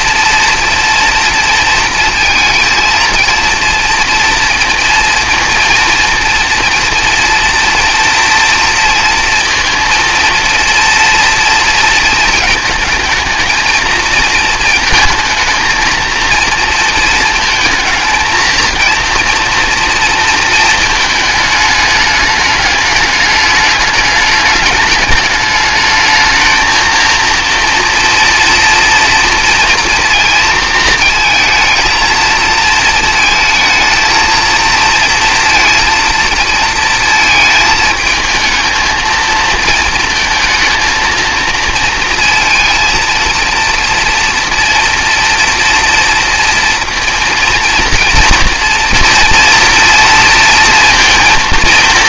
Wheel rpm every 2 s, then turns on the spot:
230, 230, 230, 230, 230, 230, 220, 230, 230, 230, 220, 210, 210, 230, 230, 220, 220, 230, 230, 220, 220, 230, 230, 230, 240, 230.
none